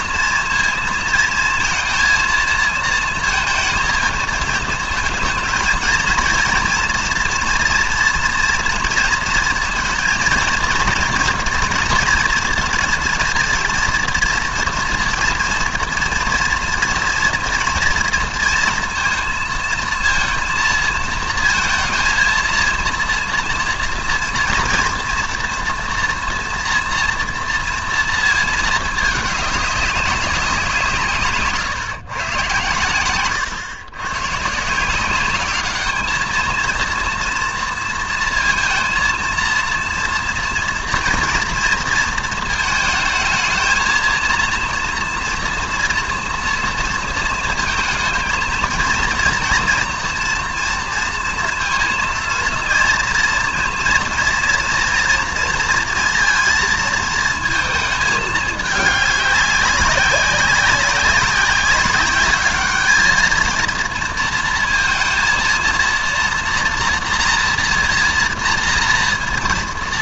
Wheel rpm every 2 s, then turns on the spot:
230, 230, 220, 230, 230, 240, 230, 230, 240, 230, 230, 230, 230, 230, 220, 170, 120, 160, 230, 230, 230, 220, 230, 230, 230, 230, 230, 230, 230, 210, 200, 210, 230, 240, 230.
none